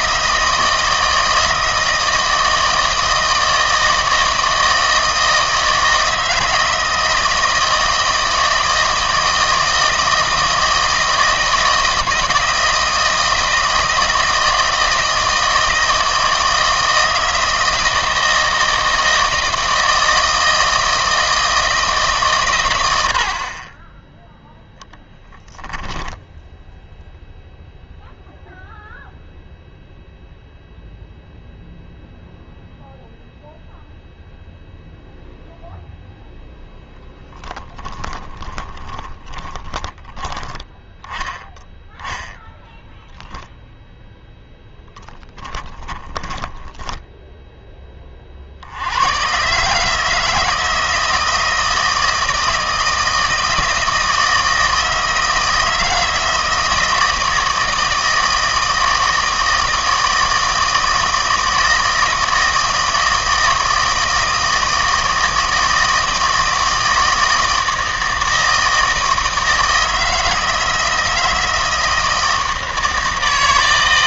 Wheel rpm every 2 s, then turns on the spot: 160, 160, 160, 160, 160, 160, 160, 160, 160, 160, 160, 100, 0, 0, 0, 0, 0, 0, 0, 20, 20, 0, 10, 10, 70, 160, 160, 160, 160, 160, 160, 160, 160, 160, 160, 160, 160.
38-40 44-46